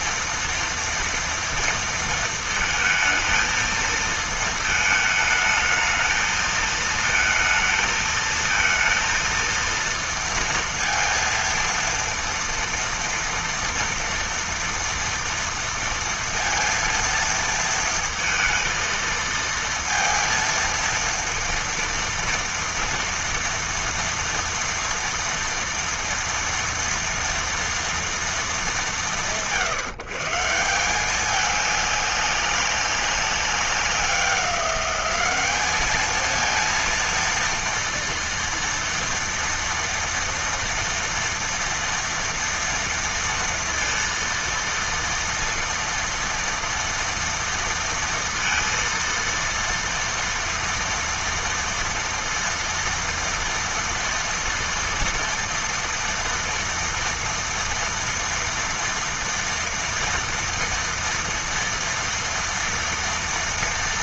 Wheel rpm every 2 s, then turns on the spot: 230, 220, 220, 220, 230, 230, 230, 230, 230, 230, 230, 230, 230, 230, 170, 180, 200, 190, 230, 230, 230, 230, 230, 230, 230, 230, 230, 230, 230, 230, 230, 230.
none